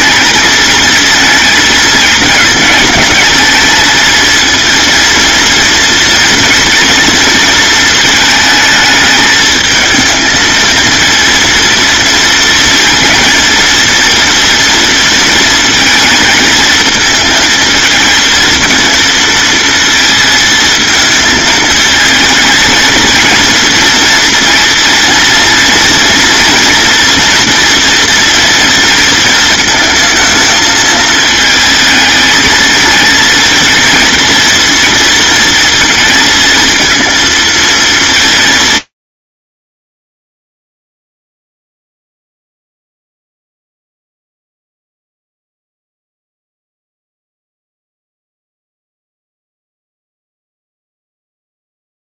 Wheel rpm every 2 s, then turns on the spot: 220, 220, 230, 230, 220, 230, 230, 230, 220, 230, 220, 230, 230, 240, 230, 220, 220, 230, 230, 100, 0, 0, 0, 0, 0, 0.
none